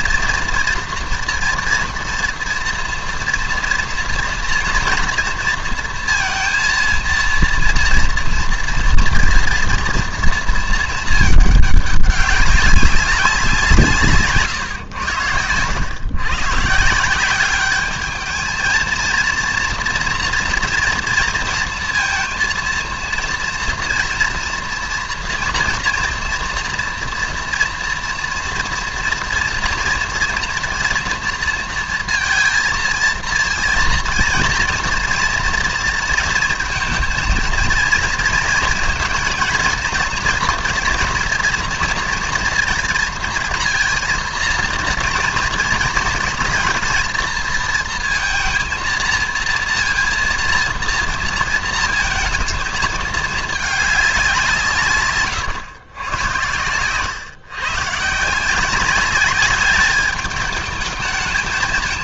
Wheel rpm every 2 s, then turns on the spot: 230, 240, 230, 230, 230, 220, 190, 130, 150, 220, 230, 230, 230, 230, 230, 230, 230, 230, 230, 220, 230, 230, 230, 220, 220, 230, 220, 150, 110, 180, 220.
none